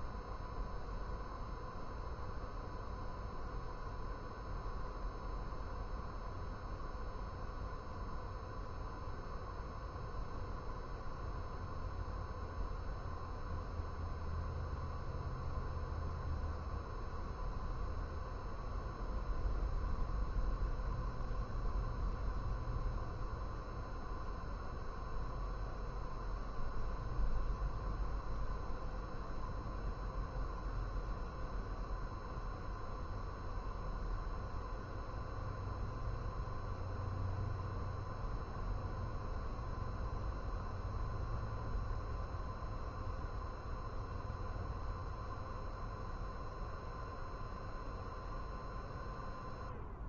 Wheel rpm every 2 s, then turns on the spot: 0, 0, 0, 0, 0, 0, 0, 0, 0, 0, 0, 0, 0, 0, 0, 0, 0, 0, 0, 0, 0, 0, 0, 0, 0.
none